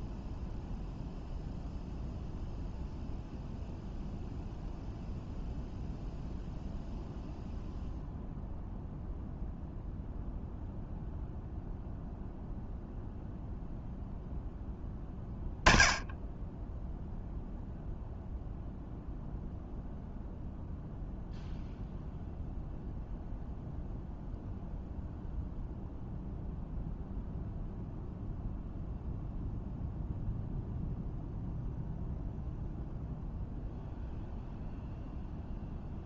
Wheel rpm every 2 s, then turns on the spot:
0, 0, 0, 0, 0, 0, 0, 10, 0, 0, 0, 0, 0, 0, 0, 0, 0, 0.
none